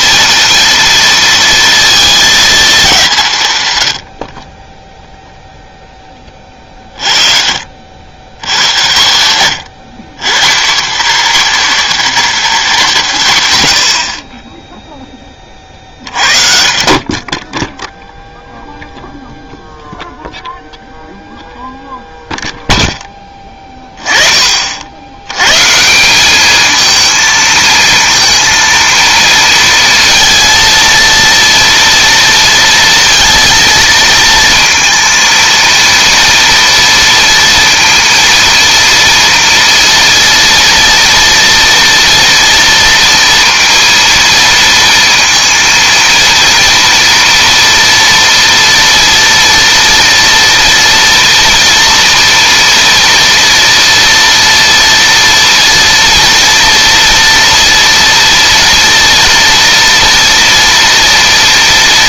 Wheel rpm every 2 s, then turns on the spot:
230, 210, 20, 40, 120, 210, 220, 10, 50, 0, 0, 0, 50, 220, 230, 230, 230, 230, 230, 230, 230, 230, 230, 230, 230, 230, 230, 230, 240, 230, 230.
none